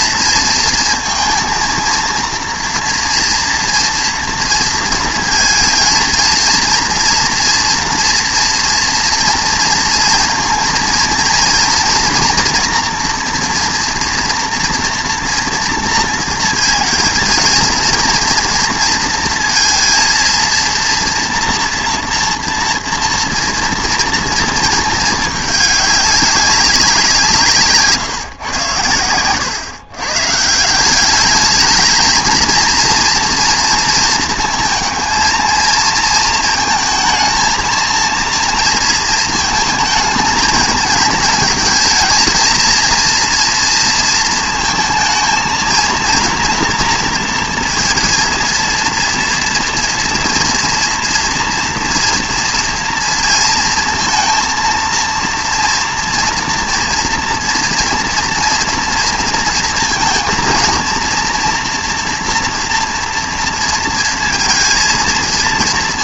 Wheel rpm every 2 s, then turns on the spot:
230, 230, 230, 230, 230, 230, 240, 230, 230, 230, 230, 230, 220, 190, 120, 170, 230, 230, 230, 230, 220, 230, 230, 230, 230, 230, 230, 230, 230, 230, 230, 240, 230.
none